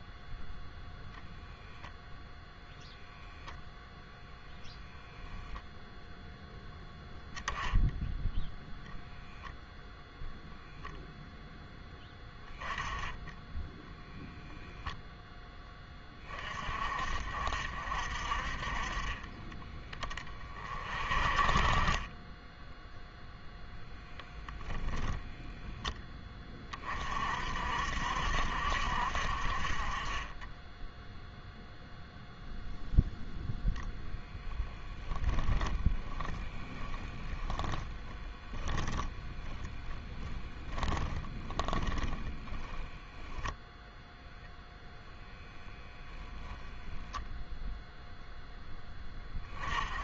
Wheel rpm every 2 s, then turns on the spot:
0, 0, 0, 0, 0, 0, 10, 0, 40, 40, 30, 10, 10, 30, 60, 10, 0, 0, 10, 20, 10, 10, 0, 0, 10.
36-42